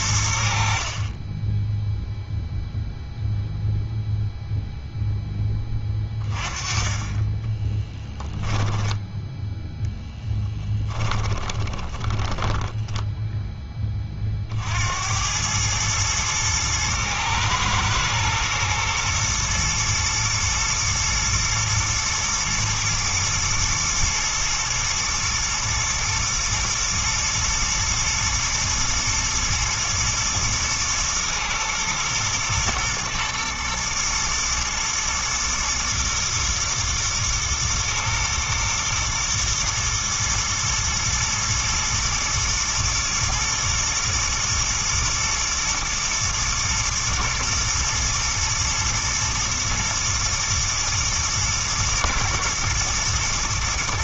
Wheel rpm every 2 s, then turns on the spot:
40, 0, 0, 30, 10, 10, 10, 70, 110, 120, 110, 110, 110, 110, 120, 110, 110, 120, 110, 120, 110, 120, 120, 110, 120, 110, 110.
8-14